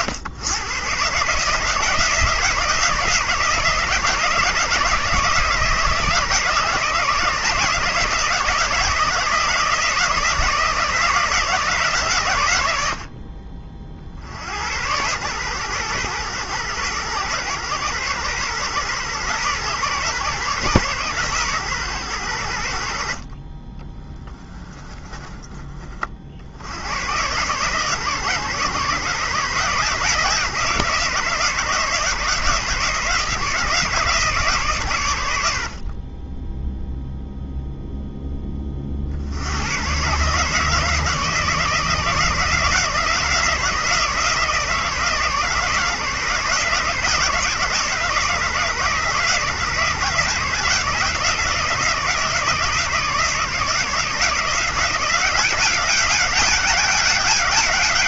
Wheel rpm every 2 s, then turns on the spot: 120, 160, 160, 160, 170, 160, 70, 100, 120, 130, 130, 70, 20, 100, 150, 160, 150, 140, 0, 30, 150, 170, 160, 160, 150, 160, 160, 170, 200.
24-26